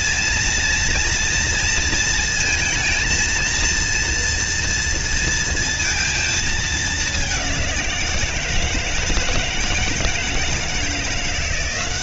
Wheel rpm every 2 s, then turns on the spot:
230, 230, 230, 220, 170, 160.
none